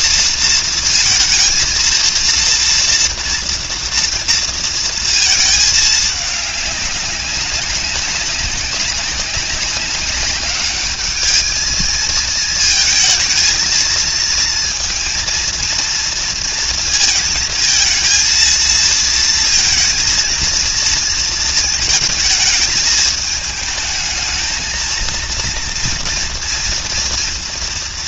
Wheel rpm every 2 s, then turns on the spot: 230, 230, 230, 200, 200, 200, 220, 230, 230, 230, 230, 220, 220, 230.
none